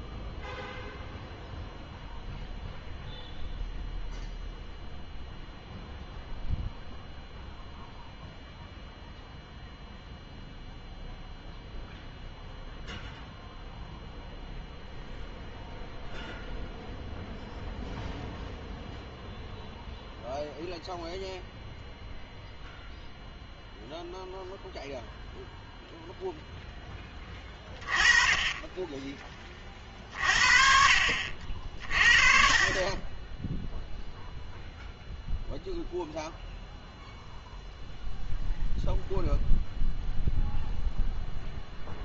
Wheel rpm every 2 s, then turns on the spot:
0, 0, 0, 0, 0, 0, 0, 0, 0, 0, 0, 0, 0, 10, 20, 50, 40, 0, 0, 0, 0.
none